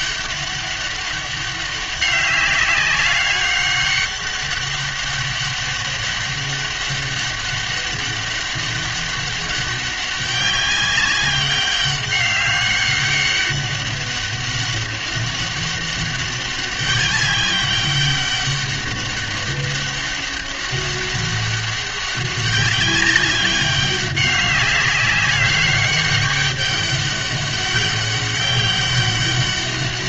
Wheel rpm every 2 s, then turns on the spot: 200, 200, 200, 200, 200, 200, 200, 200, 200, 200, 200, 200, 200, 200, 190.
none